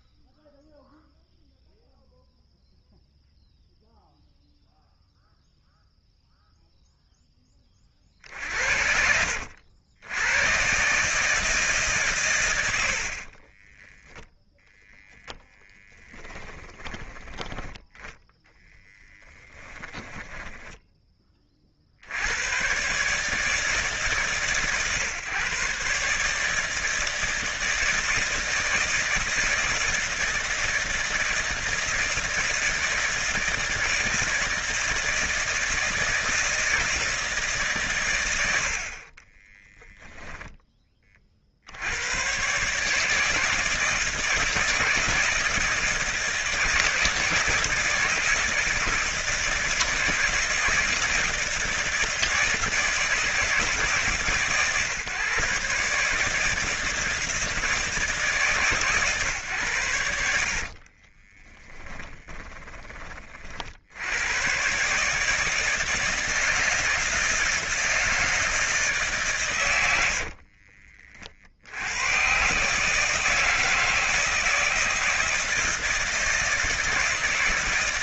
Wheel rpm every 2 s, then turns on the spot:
0, 0, 0, 0, 70, 120, 110, 0, 10, 20, 10, 110, 140, 150, 160, 160, 160, 160, 160, 90, 10, 130, 160, 160, 160, 160, 160, 140, 160, 150, 60, 20, 130, 160, 160, 60, 140, 160, 170.
18-22 60-62 70-72